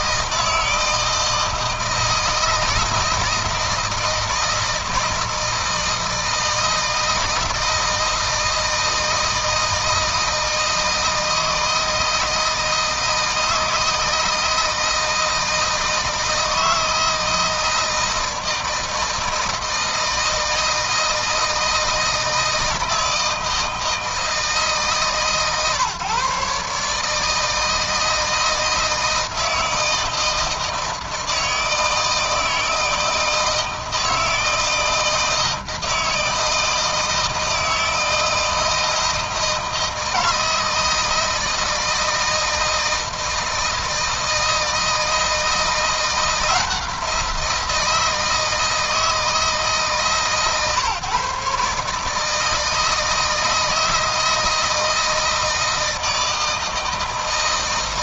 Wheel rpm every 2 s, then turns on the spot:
160, 160, 160, 160, 160, 160, 160, 160, 160, 160, 160, 160, 150, 150, 160, 160, 160, 160, 160, 160, 160, 160, 160, 170, 160, 140, 160, 160, 160.
none